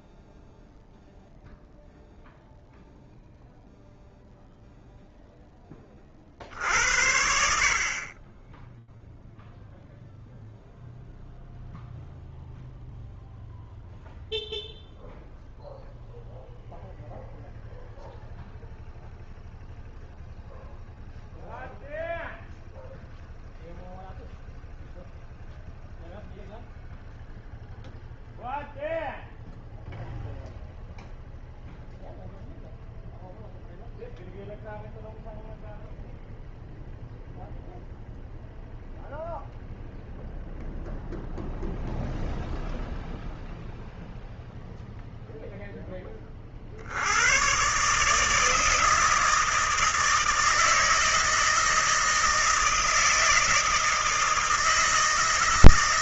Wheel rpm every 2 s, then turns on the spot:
0, 0, 0, 70, 0, 0, 0, 0, 0, 0, 0, 0, 0, 0, 0, 0, 0, 0, 0, 0, 0, 0, 0, 120, 160, 160, 160, 160.
none